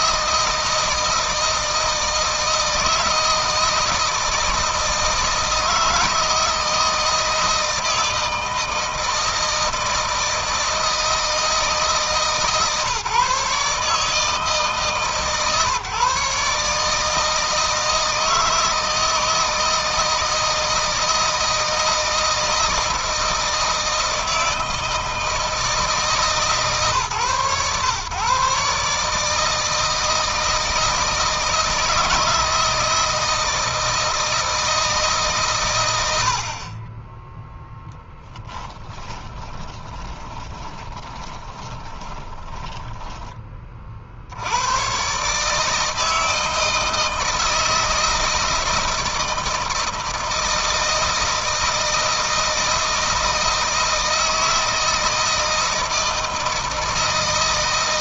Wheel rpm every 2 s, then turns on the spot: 160, 160, 160, 160, 160, 160, 140, 150, 150, 160, 160, 170, 160, 140, 140, 160, 160, 150, 30, 10, 20, 10, 110, 160, 160, 160, 160, 160, 160.
38-44